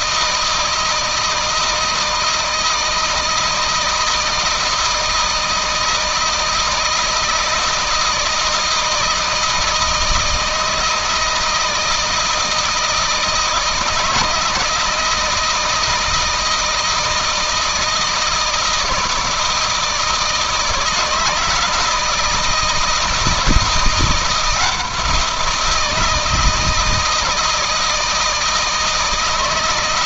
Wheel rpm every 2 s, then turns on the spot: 160, 160, 160, 160, 160, 160, 160, 160, 160, 160, 160, 160, 170, 160, 160.
none